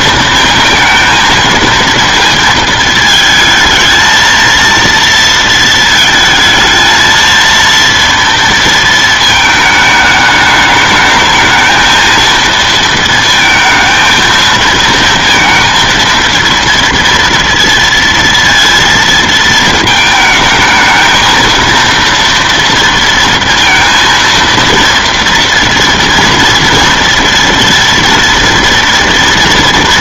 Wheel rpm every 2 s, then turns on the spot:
230, 230, 230, 220, 230, 210, 220, 220, 230, 230, 220, 230, 230, 230, 230.
none